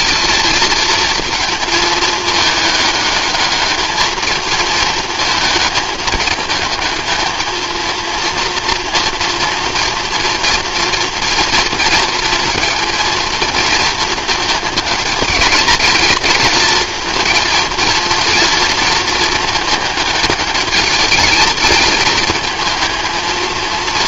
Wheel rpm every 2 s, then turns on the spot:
230, 210, 220, 220, 230, 230, 230, 220, 230, 230, 210, 220.
none